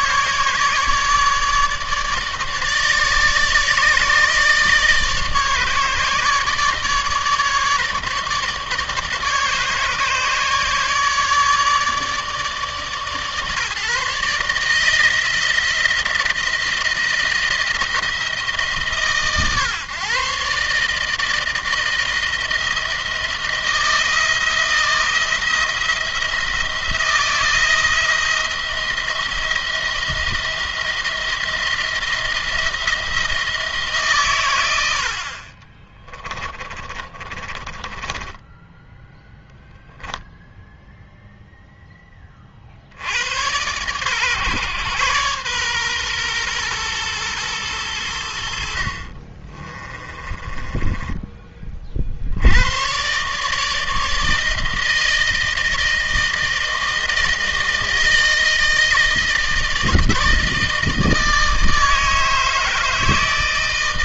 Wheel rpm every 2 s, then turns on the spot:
150, 150, 150, 150, 150, 150, 140, 150, 170, 160, 150, 160, 170, 170, 170, 170, 170, 100, 40, 10, 0, 50, 120, 120, 60, 20, 100, 160, 160, 160, 160, 160.
36-40 48-52